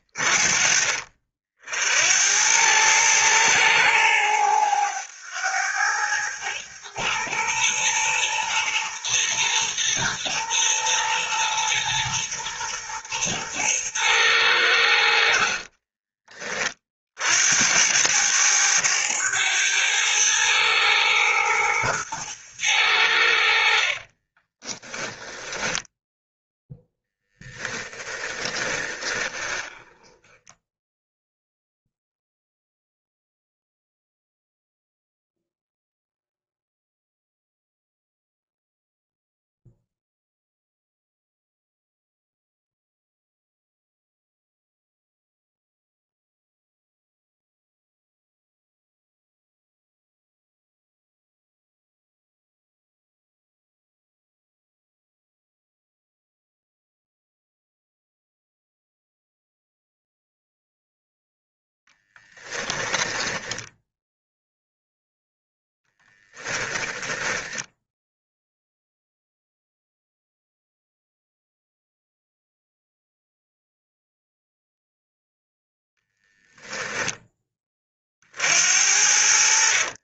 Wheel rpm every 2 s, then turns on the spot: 50, 110, 100, 110, 110, 120, 110, 90, 50, 100, 110, 90, 10, 0, 20, 10, 0, 0, 0, 0, 0, 0, 0, 0, 0, 0, 0, 0, 0, 0, 0, 10, 0, 10, 0, 0, 0, 0, 10, 60.
24-26 28-32 62-64 66-68